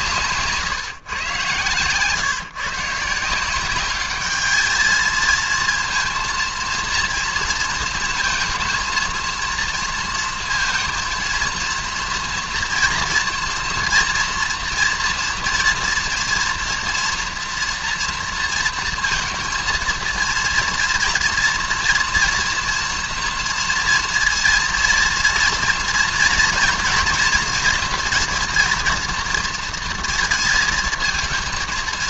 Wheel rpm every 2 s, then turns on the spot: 150, 140, 220, 230, 230, 230, 230, 230, 230, 230, 230, 230, 230, 230, 240, 220.
none